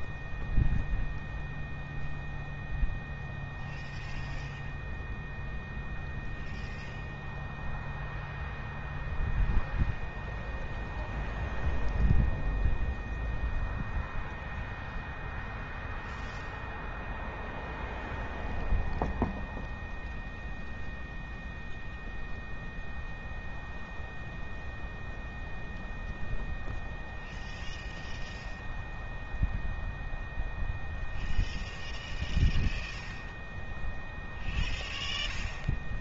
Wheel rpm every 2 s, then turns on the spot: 0, 0, 0, 0, 0, 0, 0, 0, 0, 0, 0, 0, 0, 0, 0, 0, 0, 0.
none